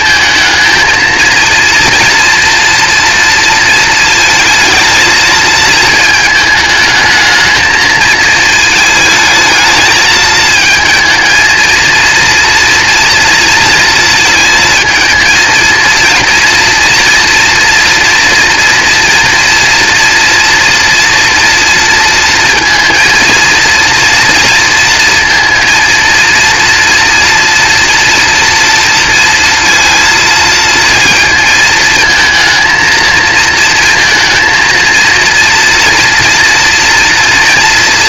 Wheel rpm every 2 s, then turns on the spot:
220, 230, 230, 220, 220, 220, 230, 220, 240, 240, 240, 230, 230, 240, 230, 230, 230, 230, 230.
none